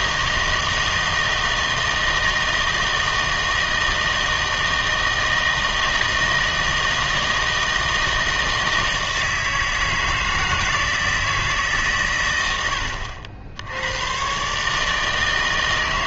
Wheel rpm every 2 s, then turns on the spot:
160, 160, 160, 160, 160, 160, 90, 150.
none